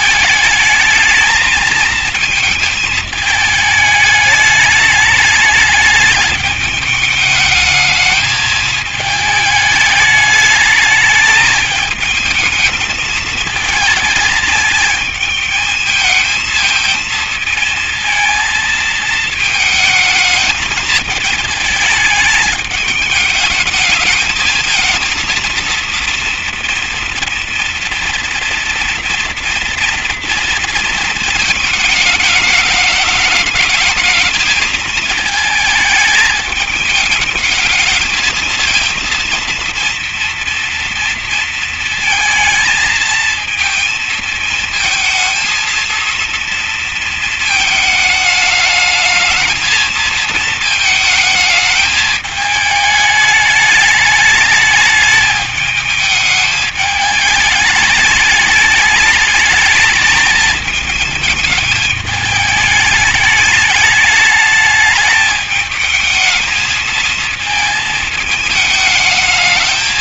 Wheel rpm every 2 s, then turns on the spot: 220, 220, 210, 210, 220, 210, 220, 220, 220, 230, 220, 210, 220, 230, 230, 230, 210, 220, 210, 230, 240, 220, 230, 230, 220, 220, 210, 210, 210, 210, 220, 210, 210, 220, 220.
none